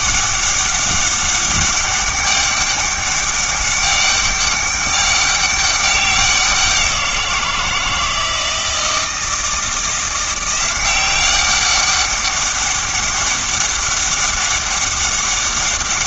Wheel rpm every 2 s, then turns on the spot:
200, 200, 200, 180, 160, 180, 200, 200.
none